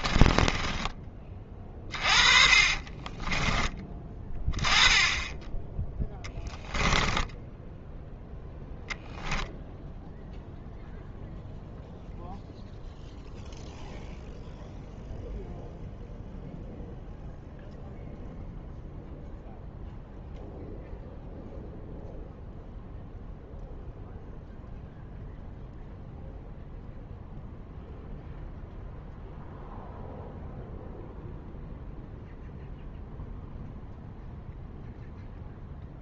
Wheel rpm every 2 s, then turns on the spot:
20, 30, 20, 10, 0, 0, 0, 0, 0, 0, 0, 0, 0, 0, 0, 0, 0, 0.
0-4 6-8